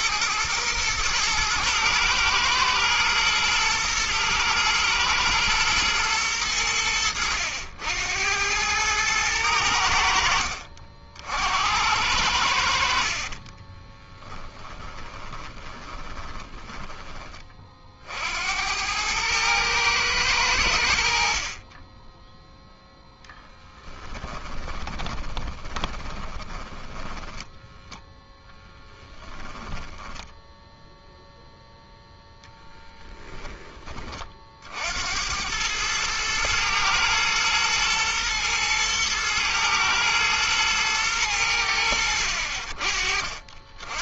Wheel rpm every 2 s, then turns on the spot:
110, 120, 110, 100, 100, 60, 70, 10, 20, 70, 90, 0, 10, 10, 0, 0, 10, 50, 110, 110, 110, 60.
14-18 24-28